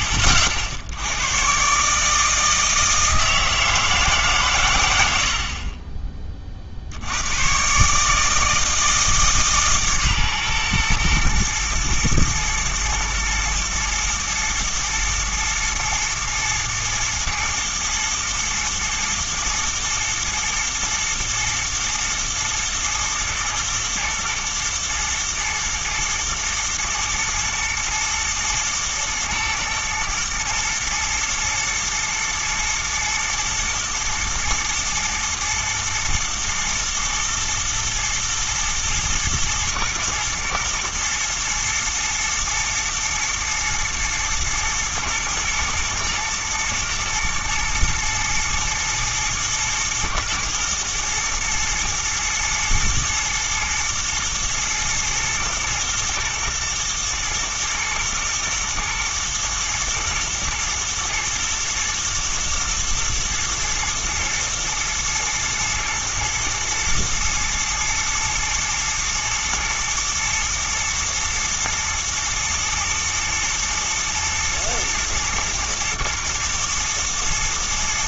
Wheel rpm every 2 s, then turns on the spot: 70, 160, 120, 50, 160, 120, 120, 110, 110, 110, 110, 110, 110, 120, 120, 110, 110, 110, 110, 110, 110, 110, 110, 110, 120, 120, 110, 110, 110, 120, 110, 120, 110, 110, 110, 120, 110, 110, 110.
none